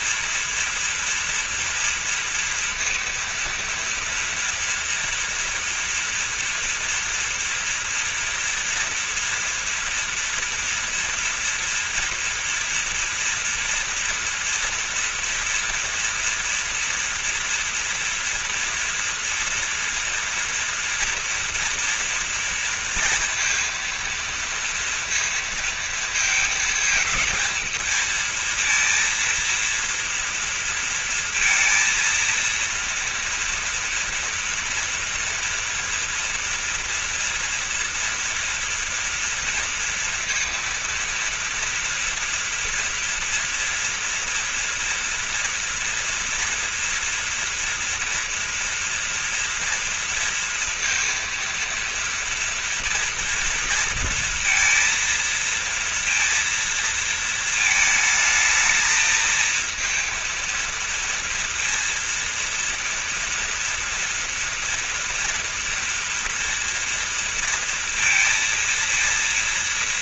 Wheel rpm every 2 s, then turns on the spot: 240, 230, 230, 230, 230, 230, 230, 230, 230, 230, 240, 230, 230, 220, 230, 230, 230, 230, 230, 230, 230, 230, 230, 240, 230, 230, 230, 230, 230, 220, 230, 230, 240, 230, 230.
none